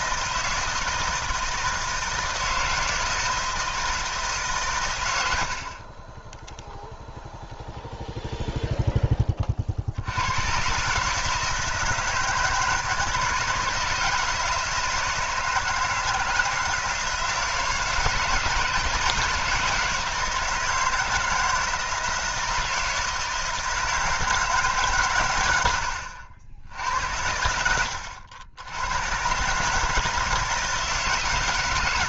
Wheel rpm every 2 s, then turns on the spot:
160, 160, 120, 0, 0, 130, 160, 160, 160, 160, 160, 160, 150, 80, 100, 160.
none